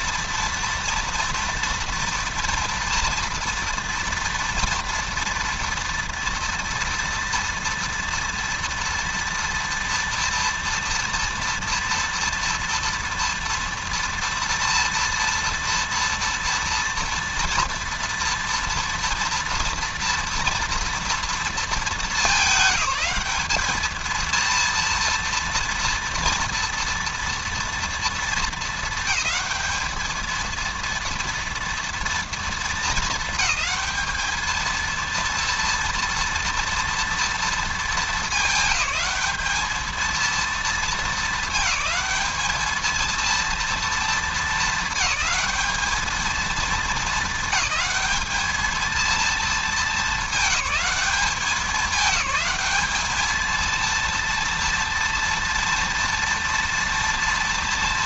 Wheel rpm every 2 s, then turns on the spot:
230, 230, 230, 230, 230, 230, 230, 230, 230, 230, 230, 210, 230, 230, 220, 220, 220, 220, 230, 220, 230, 220, 220, 220, 210, 200, 210, 230, 230.
none